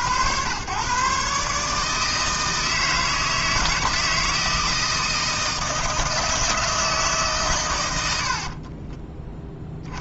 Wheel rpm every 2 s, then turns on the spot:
130, 160, 160, 160, 20.
8-10